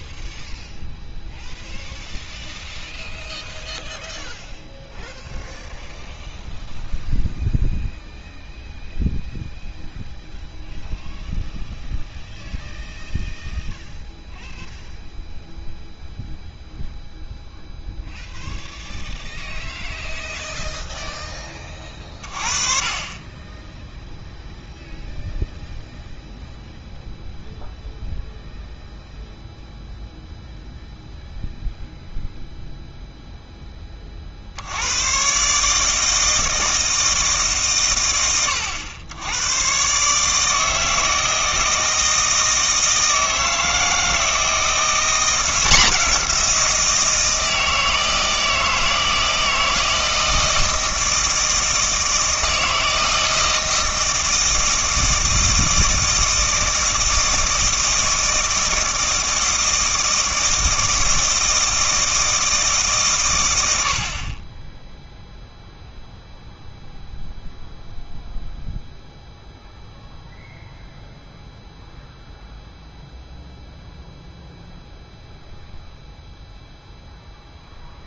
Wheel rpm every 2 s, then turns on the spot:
0, 0, 0, 0, 0, 0, 0, 0, 0, 0, 0, 30, 0, 0, 0, 0, 0, 80, 160, 100, 160, 160, 170, 170, 160, 160, 160, 160, 160, 160, 160, 150, 10, 0, 0, 0, 0, 0, 0.
none